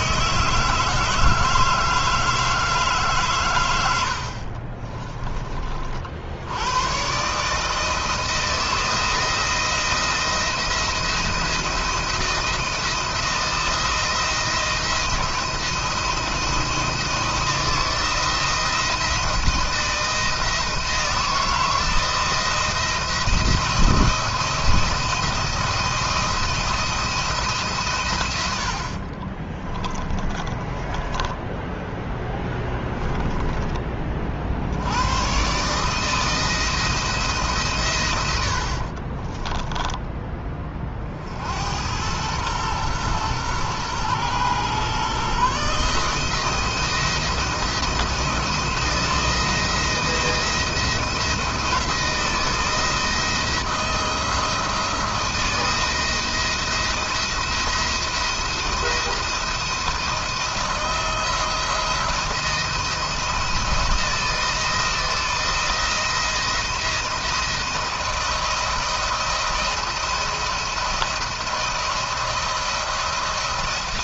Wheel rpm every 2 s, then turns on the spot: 160, 150, 40, 100, 170, 170, 170, 170, 160, 170, 160, 170, 170, 170, 100, 20, 10, 70, 160, 60, 30, 110, 130, 160, 170, 170, 170, 170, 170, 170, 170, 170, 160, 170, 170, 170, 160.
4-6 28-34 38-40